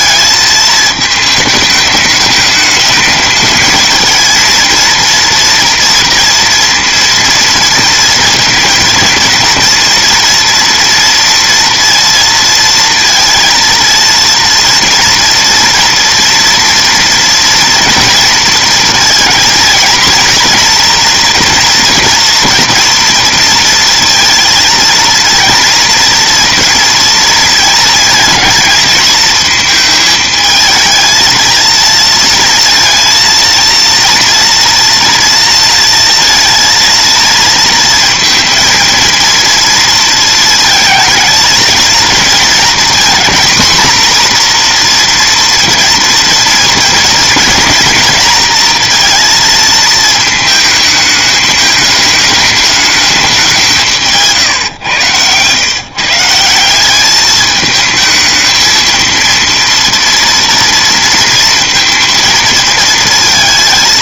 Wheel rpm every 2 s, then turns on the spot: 220, 210, 230, 230, 230, 230, 230, 230, 230, 230, 230, 240, 230, 230, 230, 220, 230, 230, 230, 230, 220, 230, 240, 230, 230, 220, 210, 120, 180, 220, 230, 230.
none